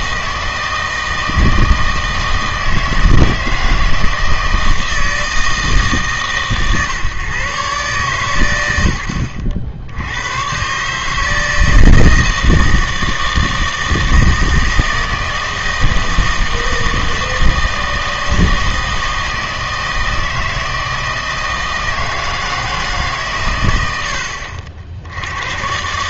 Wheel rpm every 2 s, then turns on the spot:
160, 160, 160, 140, 90, 130, 160, 160, 160, 160, 160, 160, 60.
none